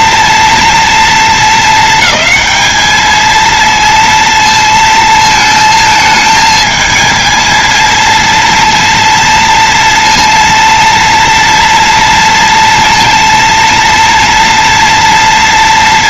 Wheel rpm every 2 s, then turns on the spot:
240, 220, 230, 220, 230, 230, 230, 230.
none